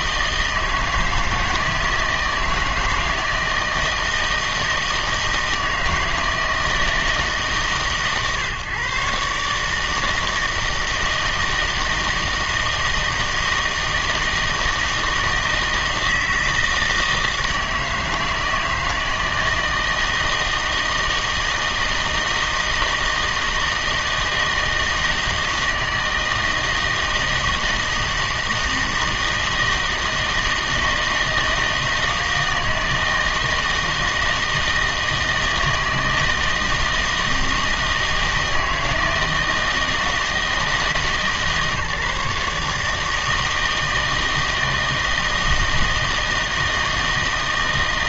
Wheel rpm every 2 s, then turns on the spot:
160, 160, 160, 160, 120, 160, 160, 160, 160, 160, 160, 160, 160, 160, 160, 160, 160, 160, 160, 160, 160, 150, 160, 160.
none